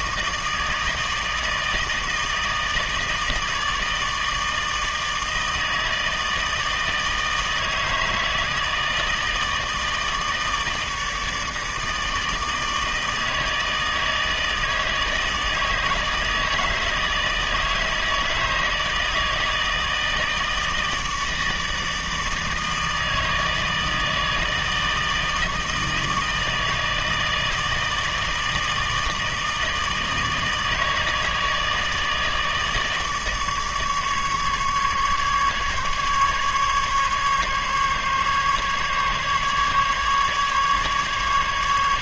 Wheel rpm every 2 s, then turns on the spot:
160, 160, 160, 160, 160, 160, 160, 160, 160, 160, 160, 160, 160, 160, 160, 150, 160, 150, 140, 140, 150.
none